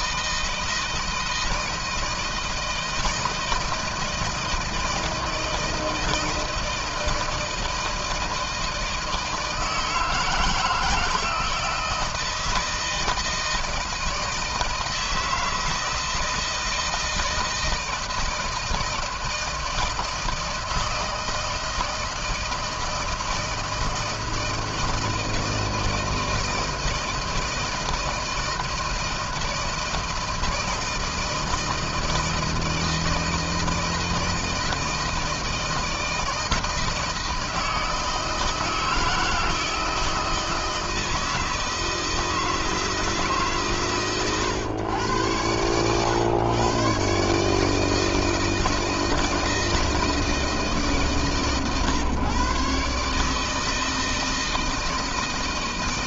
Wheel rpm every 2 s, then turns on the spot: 160, 160, 160, 160, 160, 160, 160, 160, 160, 160, 160, 160, 160, 160, 160, 160, 160, 160, 160, 160, 160, 160, 100, 130, 160, 150, 150, 160.
none